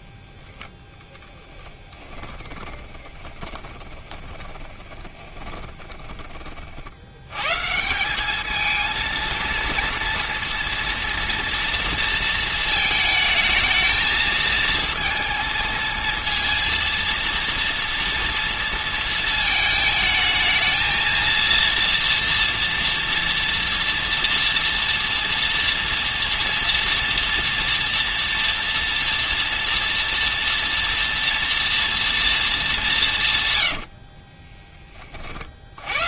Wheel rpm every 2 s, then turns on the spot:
10, 20, 20, 60, 220, 230, 220, 230, 230, 230, 220, 240, 230, 240, 230, 230, 200, 30.
2-6